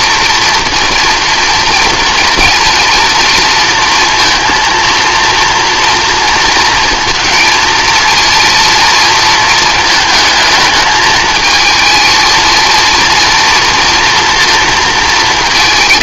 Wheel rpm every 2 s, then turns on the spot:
230, 230, 230, 230, 230, 220, 220, 230.
none